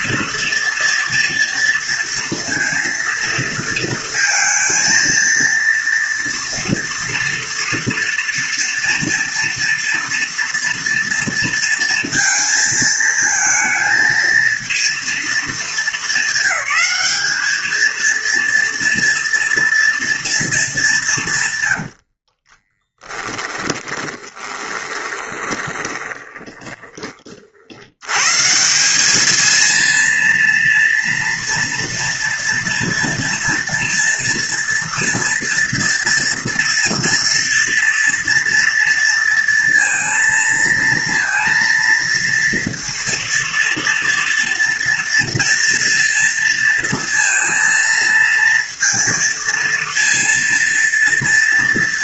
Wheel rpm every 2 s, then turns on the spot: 230, 230, 230, 230, 230, 230, 220, 220, 200, 230, 150, 20, 20, 40, 210, 230, 230, 230, 230, 230, 230, 230, 230, 230, 230, 230.
22-26